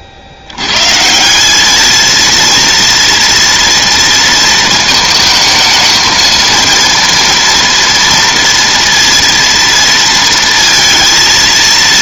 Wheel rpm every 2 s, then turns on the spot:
110, 230, 230, 230, 230, 230.
none